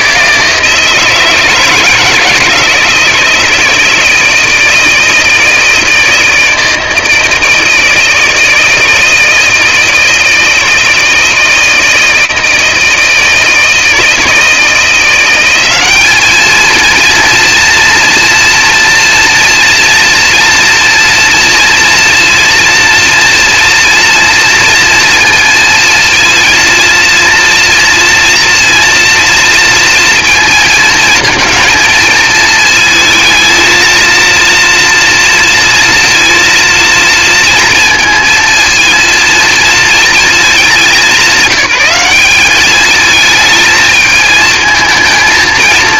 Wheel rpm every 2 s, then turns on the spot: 160, 160, 160, 160, 160, 160, 160, 160, 210, 230, 240, 240, 240, 230, 230, 230, 230, 230, 230, 230, 220, 200, 220.
none